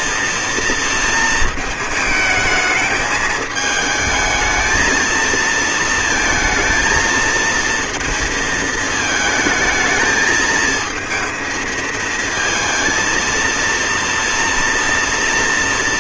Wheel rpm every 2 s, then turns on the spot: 220, 210, 230, 230, 220, 220, 230, 230.
none